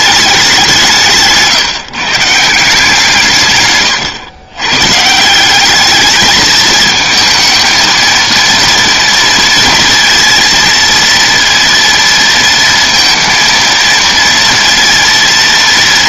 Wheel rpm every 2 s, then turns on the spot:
170, 170, 150, 220, 230, 230, 230, 230.
none